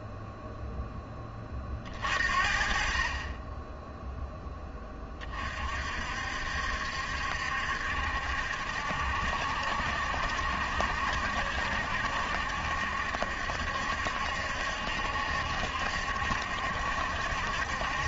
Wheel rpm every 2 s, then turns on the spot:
10, 30, 20, 70, 70, 70, 70, 70, 70.
none